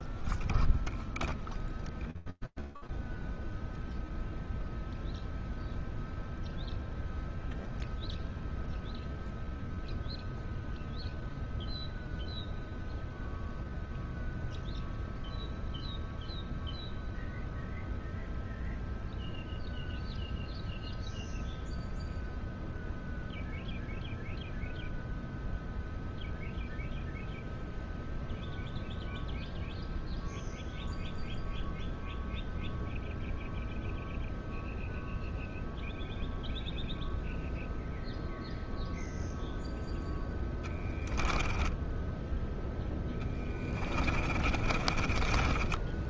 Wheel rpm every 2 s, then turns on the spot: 0, 0, 0, 0, 0, 0, 0, 0, 0, 0, 0, 0, 0, 0, 0, 0, 0, 0, 0, 0, 10, 10, 20.
40-42 44-46